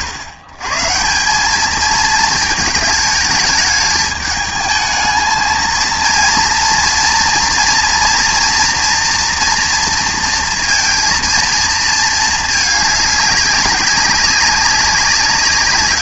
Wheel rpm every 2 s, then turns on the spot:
120, 220, 220, 230, 230, 230, 210, 200.
none